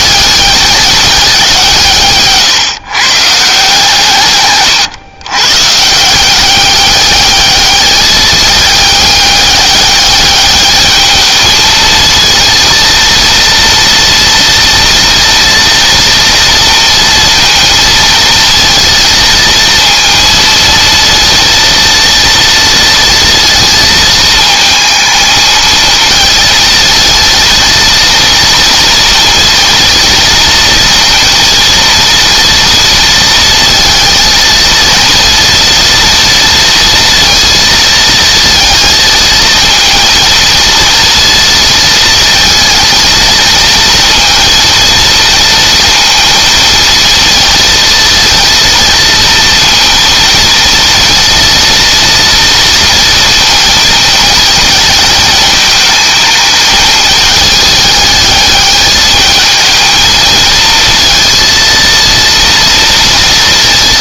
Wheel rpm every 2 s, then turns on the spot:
200, 140, 120, 200, 210, 210, 230, 230, 230, 230, 230, 230, 230, 230, 230, 230, 230, 230, 230, 230, 230, 230, 230, 230, 230, 230, 230, 220, 220, 210, 220, 230.
none